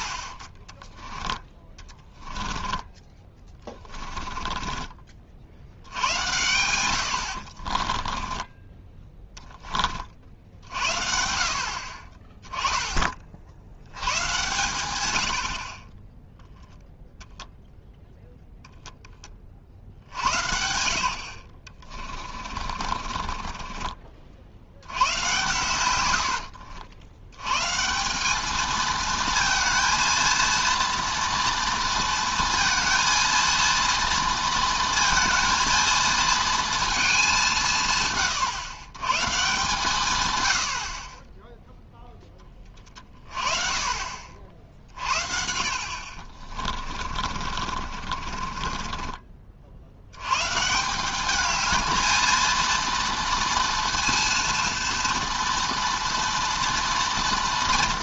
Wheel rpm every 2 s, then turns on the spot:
40, 10, 20, 90, 20, 60, 20, 120, 0, 0, 80, 40, 80, 70, 220, 230, 230, 230, 230, 110, 90, 30, 50, 40, 30, 150, 230, 230, 230.
2-6 8-10 22-24 26-28 46-50